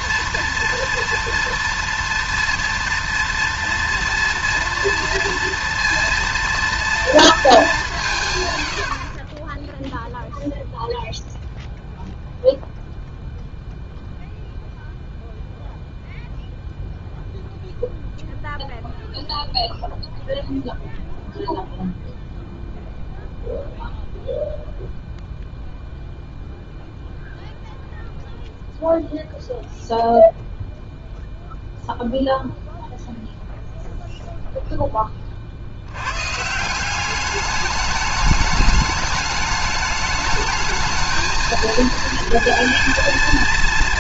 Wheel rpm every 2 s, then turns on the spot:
240, 230, 230, 230, 100, 0, 0, 0, 0, 0, 0, 0, 0, 0, 0, 0, 0, 0, 150, 210, 220, 230.
none